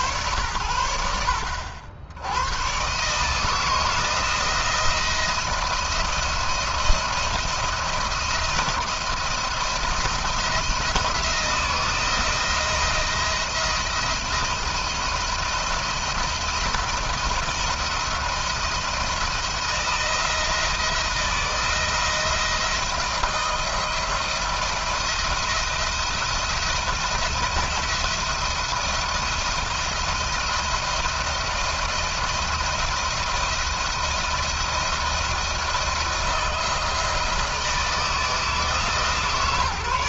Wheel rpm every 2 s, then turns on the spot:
110, 130, 160, 170, 170, 170, 170, 170, 160, 170, 170, 170, 170, 170, 160, 170, 170, 170, 160, 160.
none